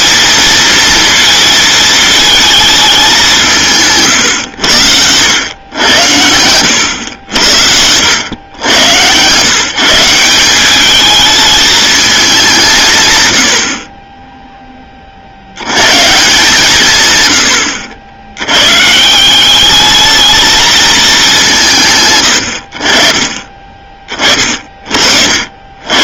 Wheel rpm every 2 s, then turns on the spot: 230, 220, 110, 90, 100, 200, 160, 20, 130, 120, 220, 50, 40.
none